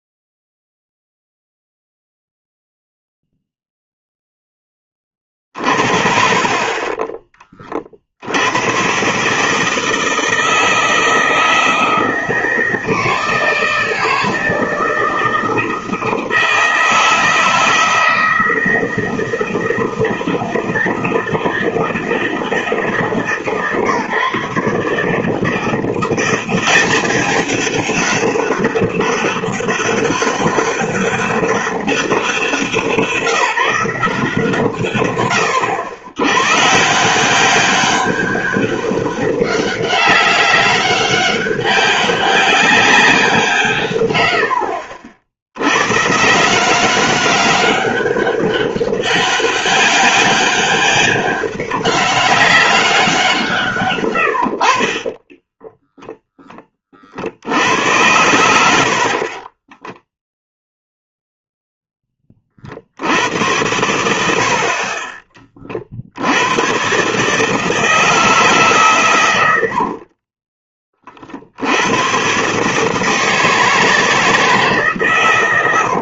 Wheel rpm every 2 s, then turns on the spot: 0, 0, 10, 40, 90, 160, 160, 160, 160, 160, 160, 160, 150, 190, 200, 200, 180, 150, 120, 200, 200, 190, 80, 170, 200, 200, 200, 70, 10, 70, 0, 30, 60, 100, 150, 30, 140, 160.
6-8 44-46 70-72